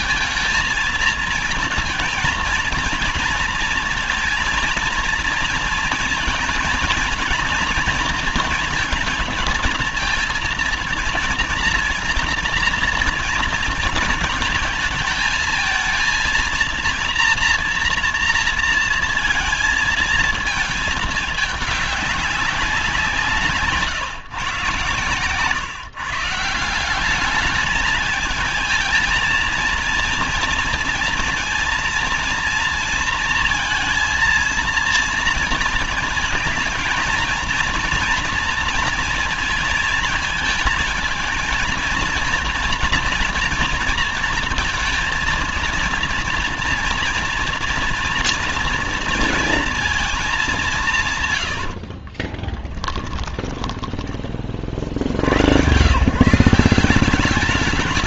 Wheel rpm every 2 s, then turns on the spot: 230, 230, 230, 230, 230, 230, 230, 220, 230, 230, 220, 200, 130, 170, 220, 230, 230, 230, 230, 230, 220, 230, 230, 230, 240, 190, 20, 40, 170.
52-54